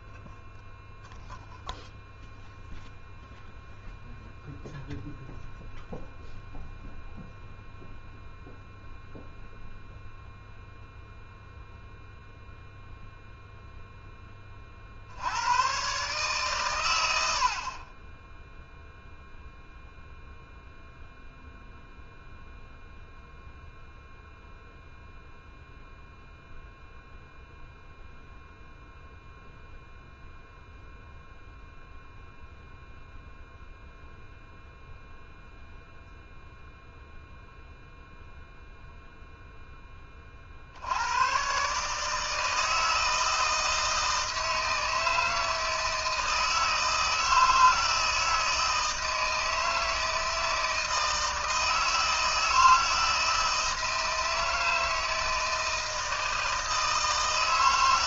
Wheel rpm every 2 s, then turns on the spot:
0, 0, 0, 0, 0, 0, 0, 50, 120, 0, 0, 0, 0, 0, 0, 0, 0, 0, 0, 0, 80, 160, 160, 160, 160, 160, 160, 160, 160.
none